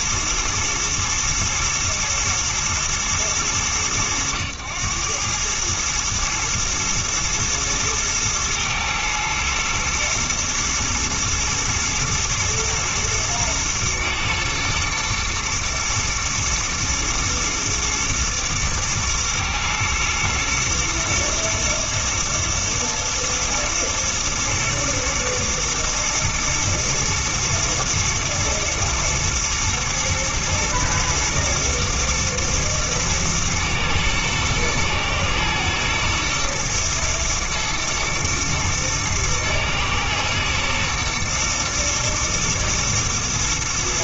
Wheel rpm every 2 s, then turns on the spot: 110, 110, 100, 110, 110, 110, 120, 110, 120, 110, 110, 110, 110, 120, 110, 120, 110, 110, 120, 110, 110, 110.
none